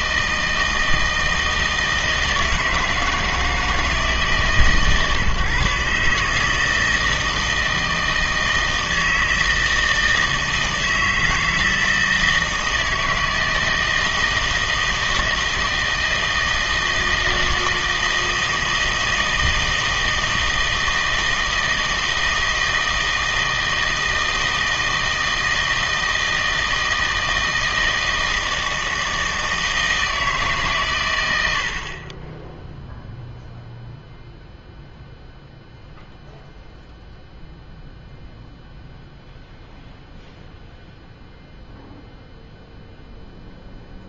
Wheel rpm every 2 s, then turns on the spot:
160, 160, 140, 160, 160, 160, 160, 160, 160, 160, 160, 160, 160, 160, 160, 140, 0, 0, 0, 0, 0, 0.
none